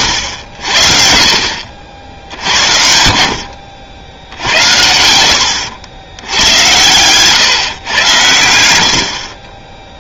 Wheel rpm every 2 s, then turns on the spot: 70, 80, 90, 100, 90.
none